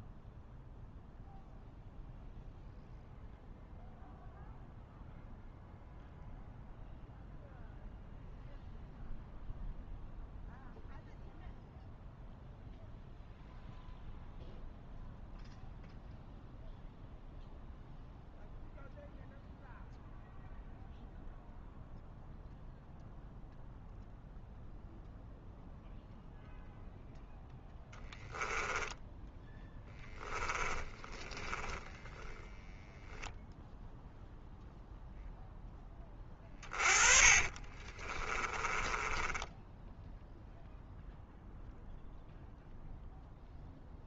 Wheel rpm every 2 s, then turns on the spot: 0, 0, 0, 0, 0, 0, 0, 0, 0, 0, 0, 0, 0, 0, 10, 10, 0, 0, 30, 20, 0, 0.
28-32 36-40